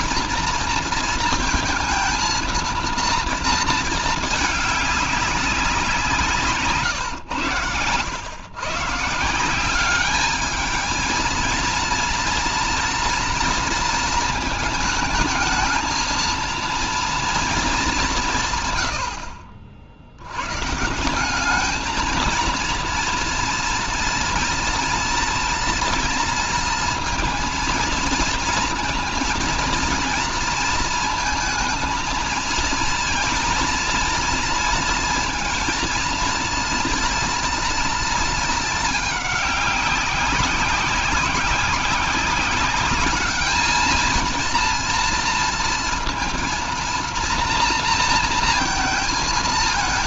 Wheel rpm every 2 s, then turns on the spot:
230, 230, 210, 140, 130, 220, 230, 220, 230, 120, 140, 230, 230, 230, 230, 230, 230, 230, 230, 220, 190, 200, 230, 230, 230.
18-20